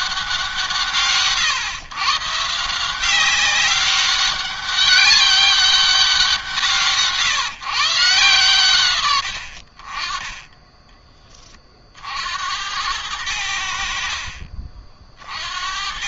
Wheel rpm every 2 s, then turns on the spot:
160, 160, 200, 170, 130, 10, 80, 50.
none